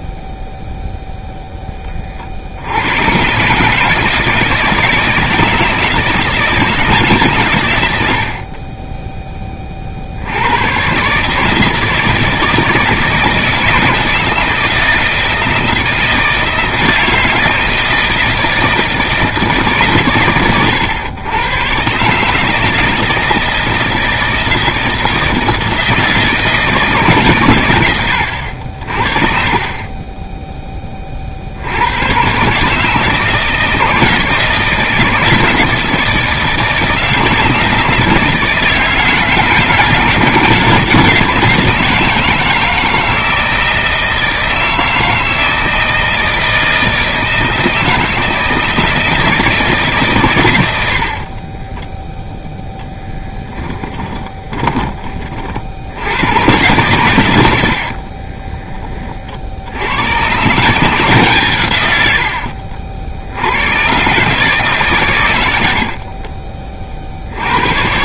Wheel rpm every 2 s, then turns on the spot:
0, 40, 160, 170, 90, 50, 160, 160, 160, 160, 130, 140, 160, 160, 100, 20, 130, 160, 160, 160, 160, 160, 160, 160, 160, 110, 0, 20, 110, 30, 150, 60, 140, 30.
54-56